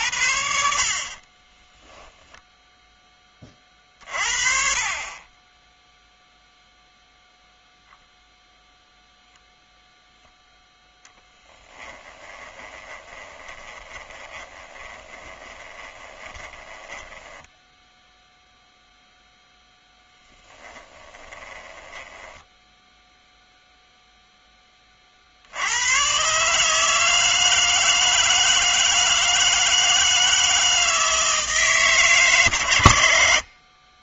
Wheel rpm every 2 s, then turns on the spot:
60, 0, 30, 0, 0, 0, 20, 20, 10, 0, 10, 10, 20, 150, 160, 160, 130.
0-2 12-18 20-24